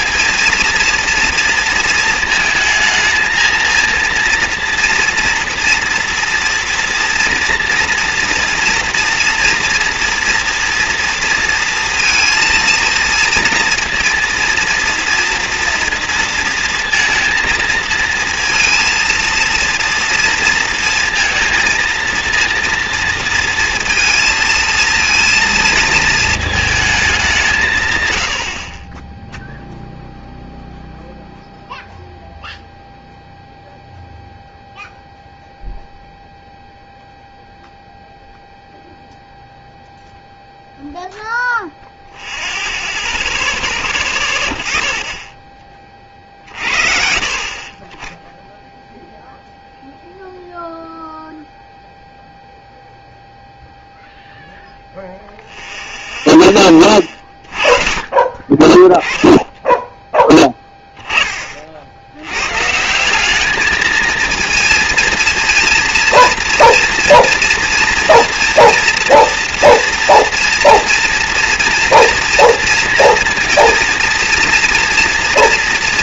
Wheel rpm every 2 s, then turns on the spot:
230, 220, 230, 230, 230, 230, 230, 230, 230, 230, 220, 230, 230, 220, 50, 0, 0, 0, 0, 0, 0, 0, 30, 50, 0, 0, 0, 0, 20, 30, 10, 130, 230, 230, 230, 230, 230, 230.
58-60